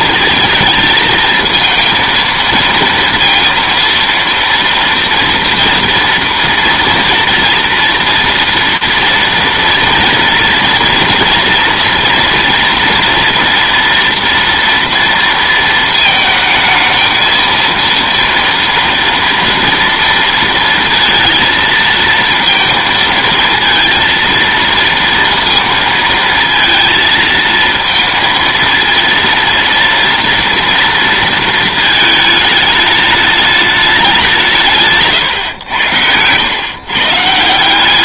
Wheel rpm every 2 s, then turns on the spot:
220, 230, 230, 230, 230, 230, 240, 230, 220, 240, 230, 230, 230, 230, 230, 230, 210, 160, 120.
none